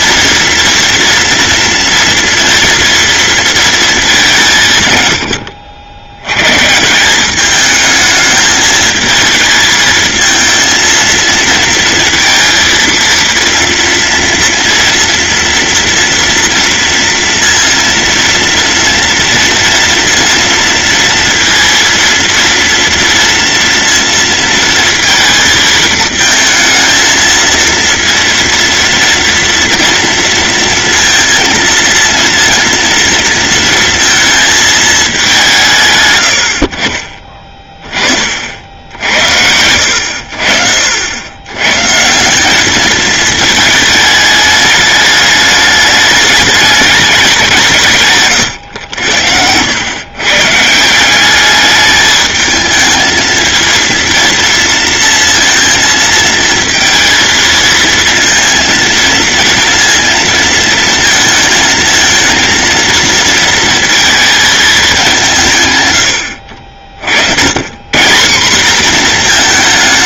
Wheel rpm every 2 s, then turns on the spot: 230, 230, 130, 160, 220, 230, 230, 230, 230, 230, 230, 230, 230, 220, 230, 230, 230, 210, 50, 80, 70, 210, 210, 200, 100, 170, 220, 230, 230, 230, 230, 230, 210, 50, 230.
48-50